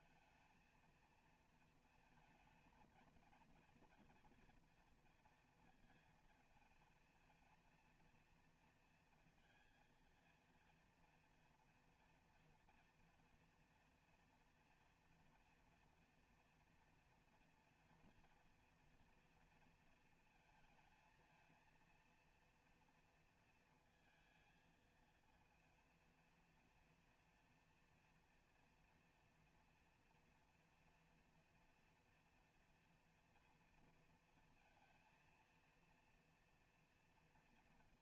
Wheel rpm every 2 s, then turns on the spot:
230, 220, 230, 230, 230, 230, 240, 230, 230, 240, 230, 230, 220, 230, 230, 230, 230, 230, 230.
none